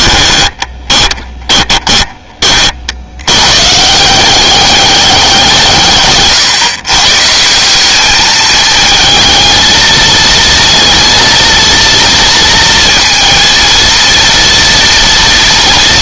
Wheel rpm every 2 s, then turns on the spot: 20, 40, 190, 130, 220, 230, 230, 240.
0-2